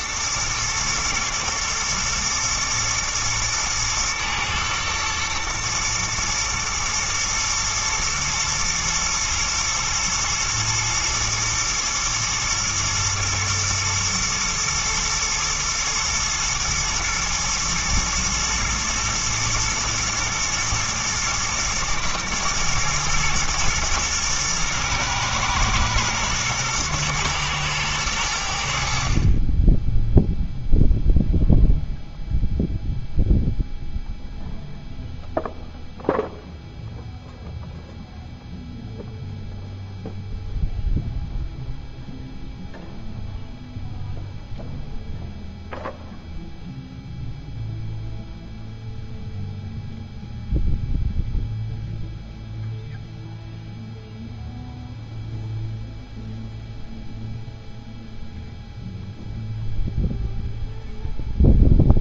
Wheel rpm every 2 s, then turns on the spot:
120, 120, 120, 110, 110, 110, 120, 120, 120, 110, 110, 120, 120, 110, 50, 0, 0, 0, 0, 0, 0, 0, 0, 0, 0, 0, 0, 0, 0, 0, 0.
none